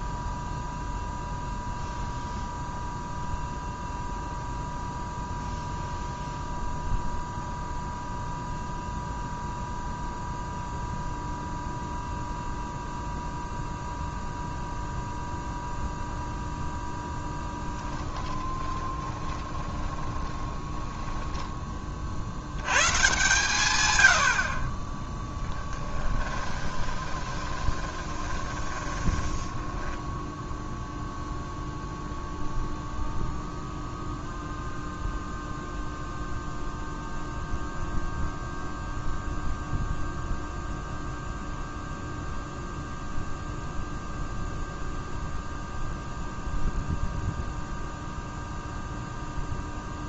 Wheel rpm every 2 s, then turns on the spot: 0, 0, 0, 0, 0, 0, 0, 0, 0, 20, 10, 120, 20, 20, 10, 0, 0, 0, 0, 0, 0, 0, 0, 0, 0.
18-22 26-30